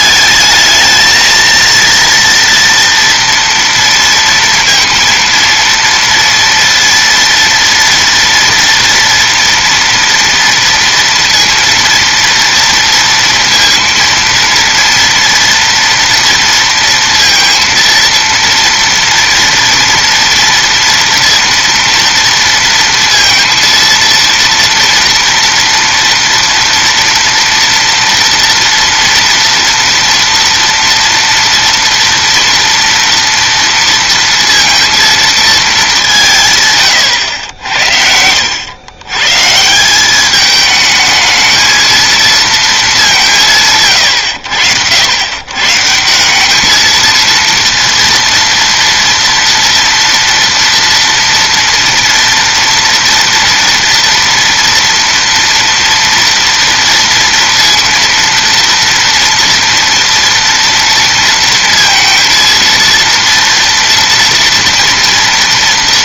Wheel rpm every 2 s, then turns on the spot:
220, 230, 230, 230, 230, 230, 230, 230, 230, 230, 230, 230, 230, 230, 230, 230, 230, 230, 160, 90, 210, 230, 100, 180, 230, 230, 230, 230, 230, 230, 230, 230, 240.
none